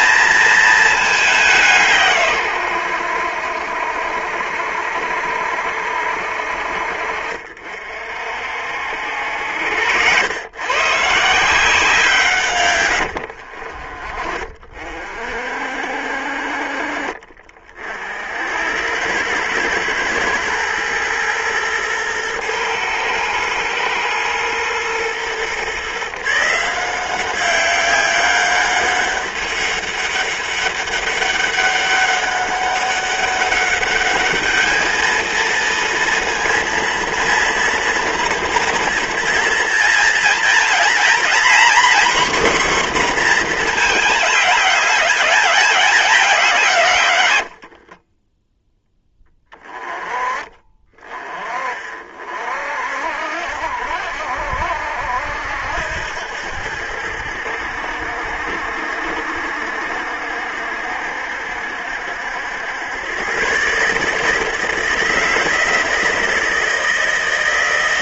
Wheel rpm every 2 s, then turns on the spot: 220, 100, 70, 60, 70, 140, 100, 40, 40, 90, 110, 120, 120, 170, 190, 200, 200, 220, 230, 240, 240, 250, 210, 160, 10, 30, 60, 70, 70, 70, 70, 100, 160, 160.
12-14